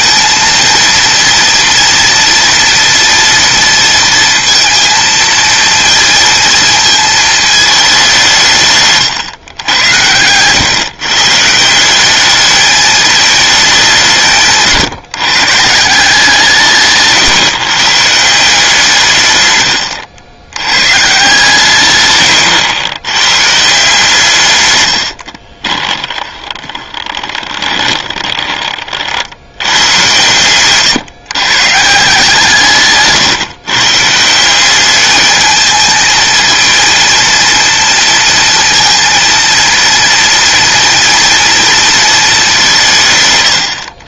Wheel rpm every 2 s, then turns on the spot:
230, 230, 230, 220, 150, 120, 220, 150, 140, 160, 120, 110, 100, 20, 30, 130, 140, 190, 230, 230, 230, 170.
26-28